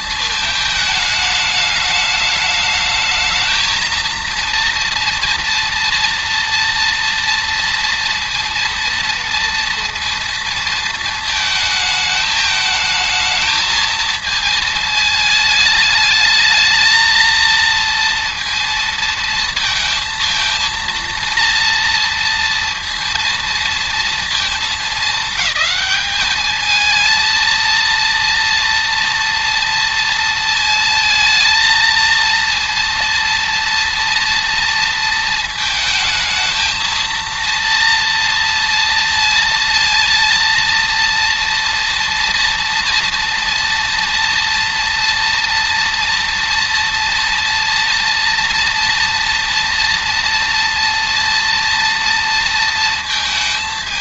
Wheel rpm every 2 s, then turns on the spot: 230, 230, 230, 230, 220, 220, 210, 230, 230, 230, 230, 220, 230, 230, 230, 230, 220, 230, 230, 230, 230, 230, 230, 230, 230, 220, 230.
none